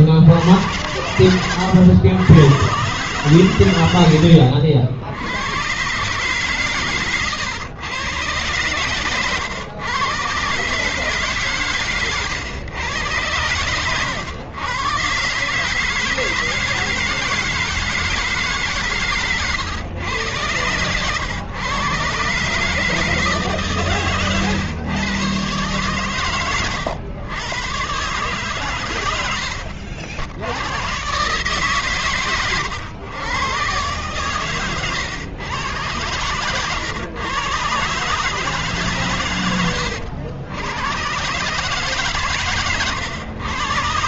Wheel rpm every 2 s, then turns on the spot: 120, 100, 90, 130, 130, 110, 130, 110, 160, 160, 110, 130, 130, 110, 120, 80, 140, 120, 110, 140, 100, 140.
0-2